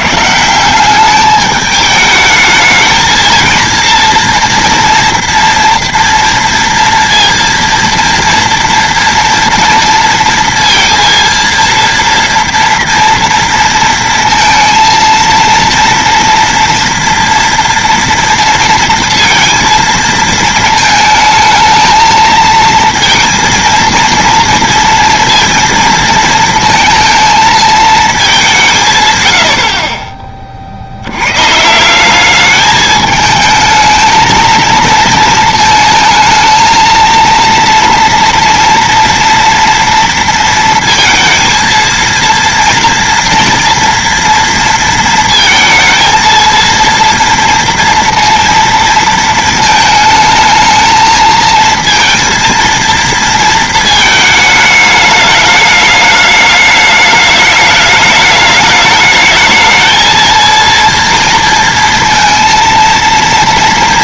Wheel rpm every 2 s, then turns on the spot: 180, 220, 240, 230, 230, 230, 230, 230, 230, 240, 220, 230, 230, 230, 170, 70, 210, 220, 230, 230, 230, 240, 230, 230, 230, 220, 230, 210, 210, 210, 230, 230.
none